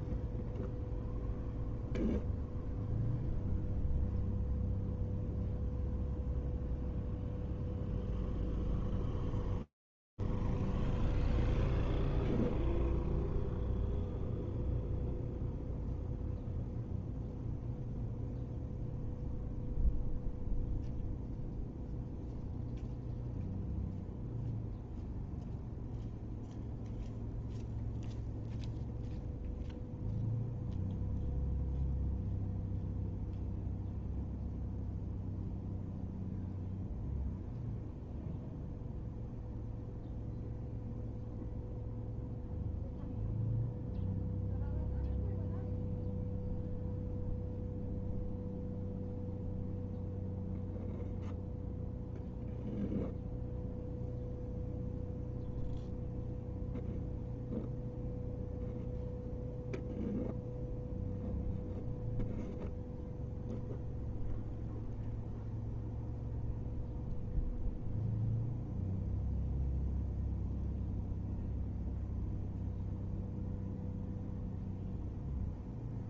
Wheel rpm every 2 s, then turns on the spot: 0, 0, 0, 0, 0, 0, 0, 0, 0, 0, 0, 0, 0, 0, 0, 0, 0, 0, 0, 0, 0, 0, 0, 0, 0, 0, 0, 0, 0, 0, 0, 0, 0, 0, 0, 0, 0, 0.
none